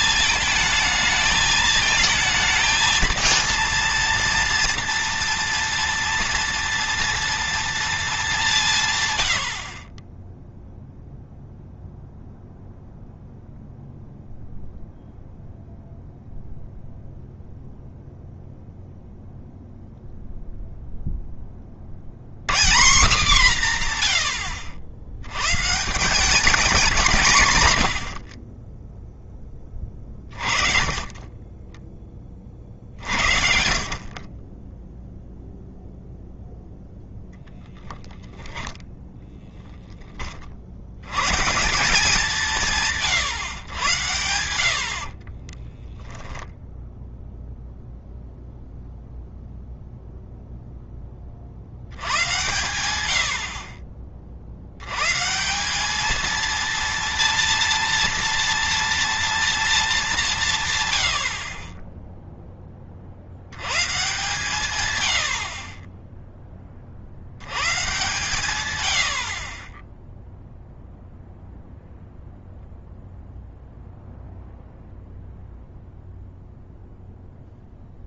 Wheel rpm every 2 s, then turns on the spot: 220, 230, 230, 230, 150, 0, 0, 0, 0, 0, 0, 180, 90, 190, 30, 30, 50, 10, 0, 10, 60, 150, 70, 0, 0, 10, 110, 80, 230, 230, 130, 30, 130, 30, 100, 0, 0, 0, 0.
44-46